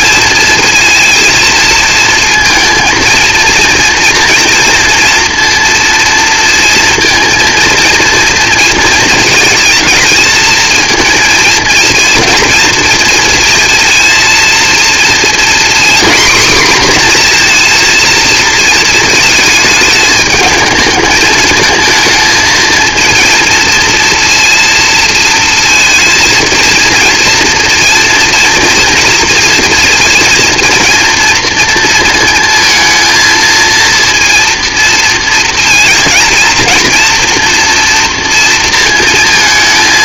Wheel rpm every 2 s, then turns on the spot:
230, 230, 230, 230, 230, 230, 230, 230, 250, 230, 220, 230, 230, 230, 240, 230, 220, 230, 230, 230.
none